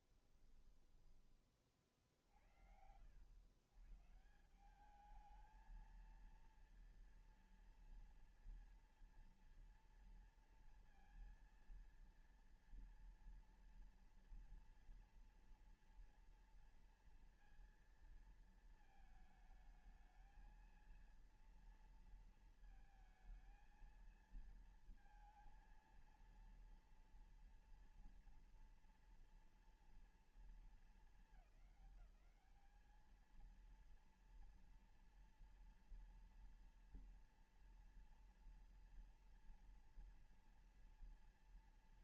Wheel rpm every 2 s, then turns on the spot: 20, 60, 160, 230, 230, 230, 230, 240, 230, 230, 220, 230, 230, 230, 230, 220, 210, 230, 230, 230, 230.
0-2